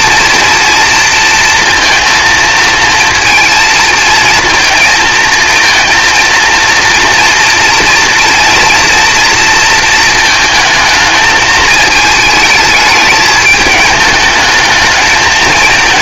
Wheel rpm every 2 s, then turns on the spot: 230, 230, 230, 230, 230, 220, 220, 220.
none